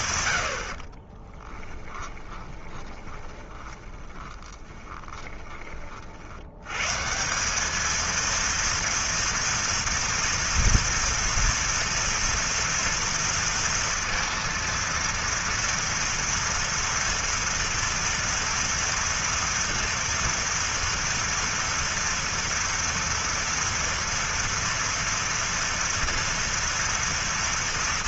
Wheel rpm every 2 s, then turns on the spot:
90, 20, 20, 120, 230, 240, 230, 230, 230, 230, 230, 230, 230, 230.
2-6